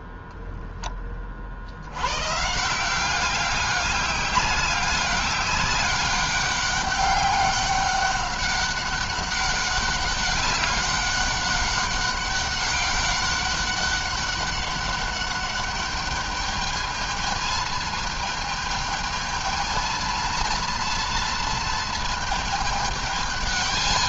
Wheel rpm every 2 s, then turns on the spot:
10, 160, 200, 200, 200, 200, 200, 200, 210, 220, 230, 220.
none